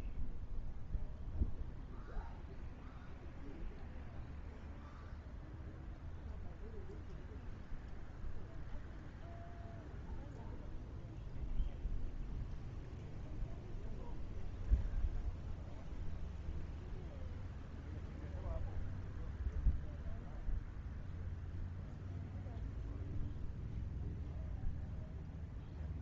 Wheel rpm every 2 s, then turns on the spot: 0, 0, 0, 0, 0, 0, 0, 0, 0, 0, 0, 0, 0.
none